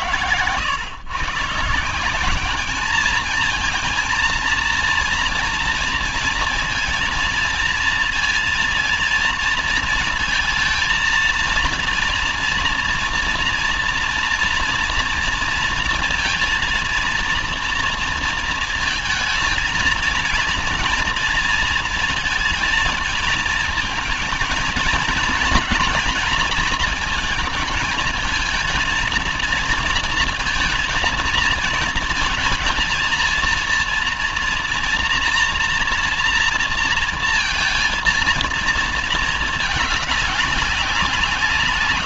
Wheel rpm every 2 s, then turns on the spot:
130, 220, 230, 230, 230, 230, 230, 230, 230, 220, 230, 230, 230, 220, 220, 230, 230, 230, 230, 220, 180.
none